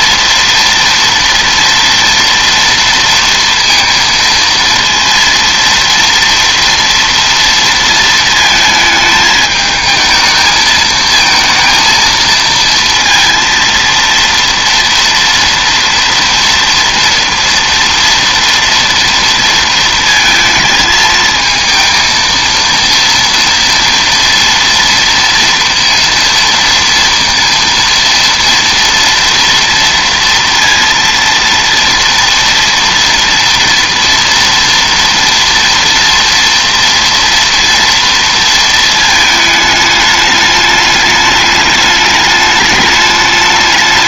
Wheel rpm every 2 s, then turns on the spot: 230, 230, 230, 230, 220, 220, 230, 230, 230, 230, 220, 230, 230, 230, 230, 230, 230, 230, 240, 230, 210, 210.
none